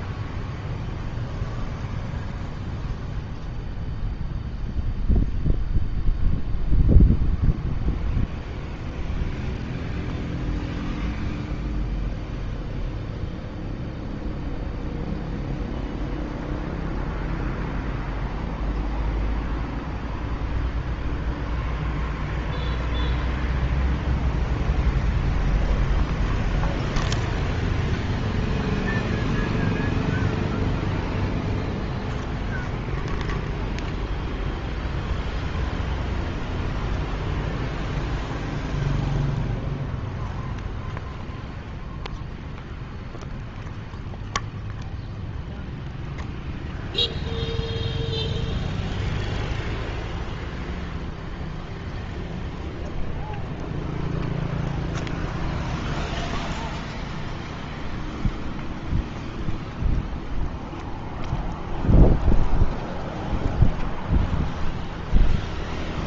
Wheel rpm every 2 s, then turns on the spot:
0, 0, 0, 0, 0, 0, 0, 0, 0, 0, 0, 0, 0, 0, 0, 0, 0, 0, 0, 0, 0, 0, 0, 0, 0, 0, 0, 0, 0, 0, 0, 0, 0.
none